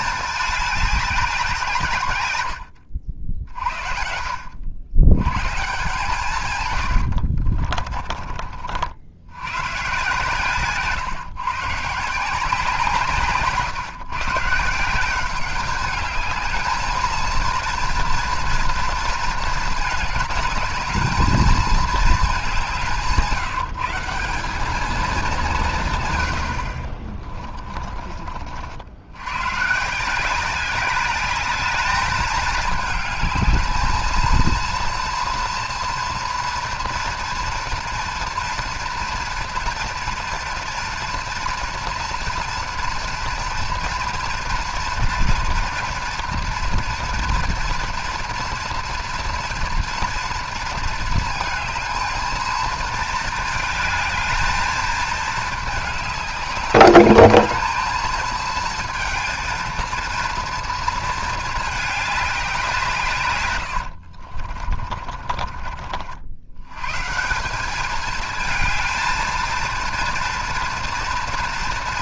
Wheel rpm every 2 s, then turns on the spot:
200, 90, 90, 120, 50, 140, 160, 160, 220, 230, 220, 180, 210, 70, 70, 190, 210, 230, 240, 240, 230, 230, 240, 230, 230, 230, 230, 220, 200, 230, 230, 180, 40, 110, 220, 230.
6-8 10-12 64-66